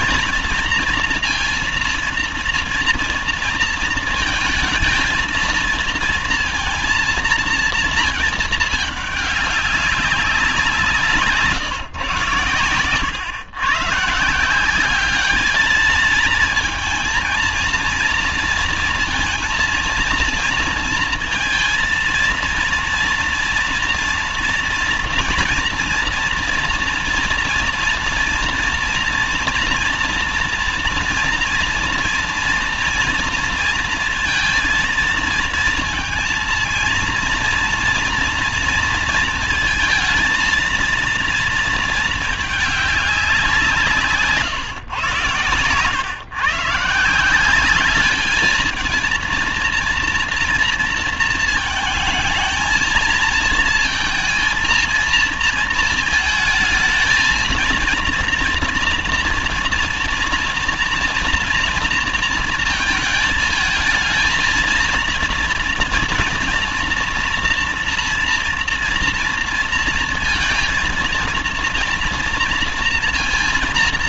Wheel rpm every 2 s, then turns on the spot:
230, 230, 220, 230, 220, 190, 120, 180, 230, 230, 230, 230, 230, 230, 230, 230, 230, 230, 230, 230, 230, 210, 130, 140, 220, 230, 220, 230, 220, 230, 230, 230, 230, 230, 230, 230, 230.
none